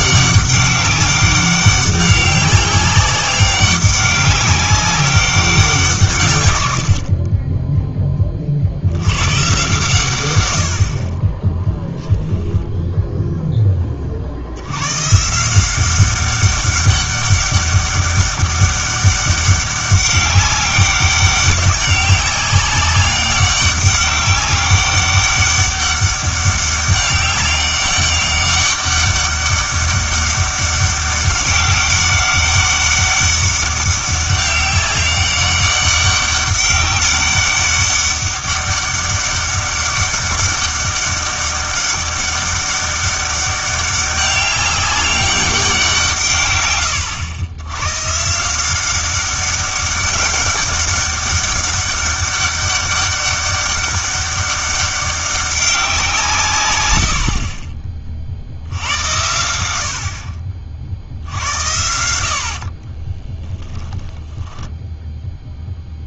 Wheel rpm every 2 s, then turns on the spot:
200, 190, 200, 100, 50, 80, 10, 110, 200, 200, 200, 200, 200, 200, 200, 200, 200, 200, 200, 200, 200, 200, 200, 120, 180, 200, 200, 200, 120, 70, 50, 50, 10.
62-66